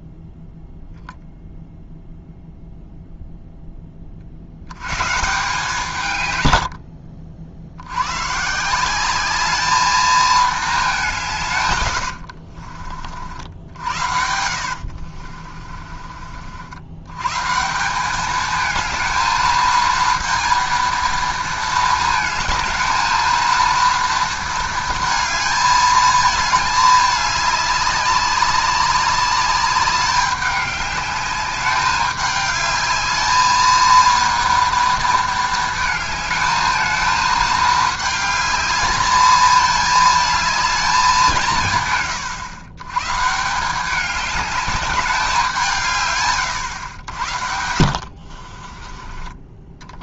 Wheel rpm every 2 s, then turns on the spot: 0, 0, 110, 60, 180, 200, 50, 60, 90, 220, 230, 220, 220, 210, 200, 200, 210, 230, 220, 210, 210, 130, 200, 100, 30.
14-16 48-50